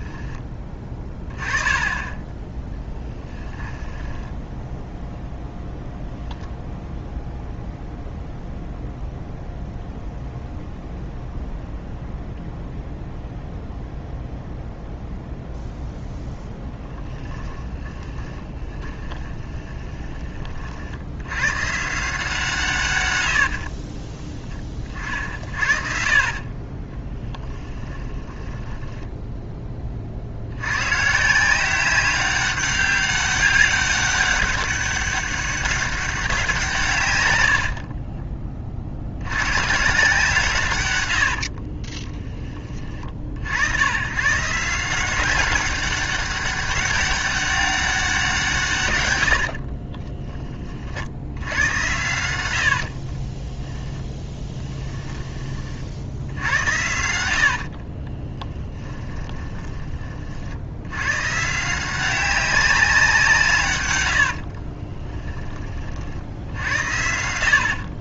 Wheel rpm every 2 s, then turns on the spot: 20, 10, 0, 0, 0, 0, 0, 0, 10, 10, 70, 120, 40, 20, 10, 120, 200, 200, 150, 50, 110, 70, 180, 200, 120, 50, 50, 10, 70, 30, 100, 180, 30, 70.
18-20 28-30 52-56 58-60 64-68